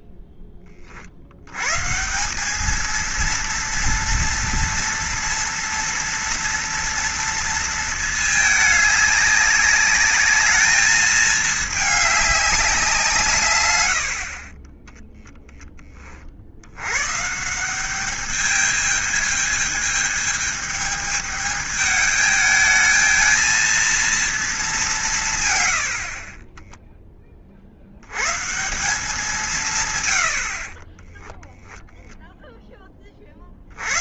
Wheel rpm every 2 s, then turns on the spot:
30, 220, 230, 230, 210, 220, 190, 20, 90, 210, 220, 220, 200, 10, 170, 40, 10.
none